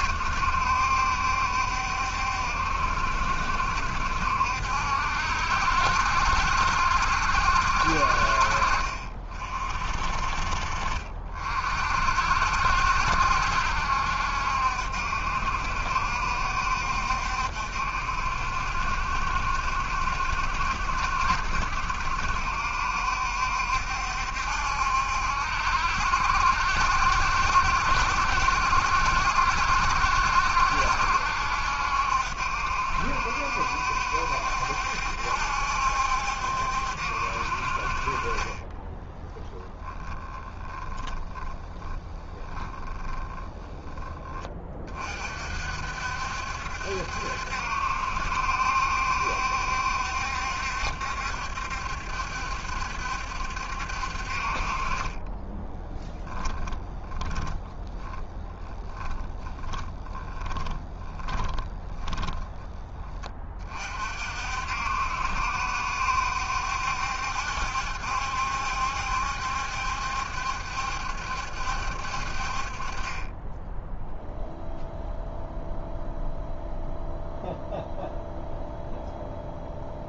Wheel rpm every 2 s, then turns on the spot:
70, 70, 70, 70, 60, 50, 60, 70, 70, 70, 60, 60, 70, 70, 70, 70, 70, 70, 70, 20, 20, 10, 30, 70, 70, 70, 70, 40, 10, 10, 10, 10, 60, 70, 70, 70, 50, 0, 0, 0.
10-12 38-44 56-62